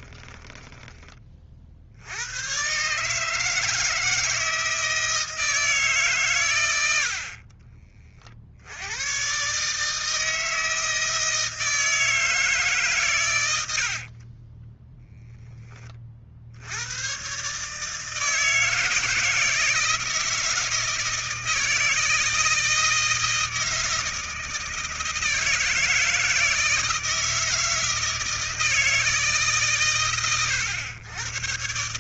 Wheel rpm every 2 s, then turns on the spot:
10, 130, 160, 100, 90, 160, 140, 10, 90, 160, 160, 160, 160, 160, 160, 110.
14-16